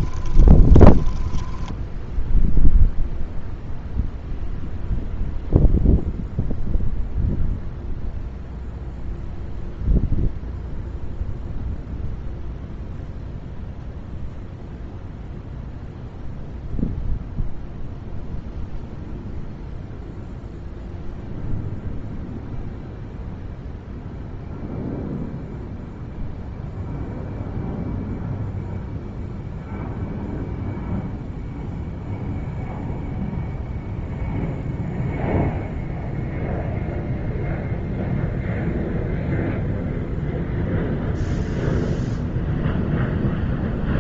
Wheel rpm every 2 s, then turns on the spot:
20, 0, 0, 0, 0, 0, 0, 0, 0, 0, 0, 0, 0, 0, 0, 0, 0, 0, 0, 0, 0, 0.
0-2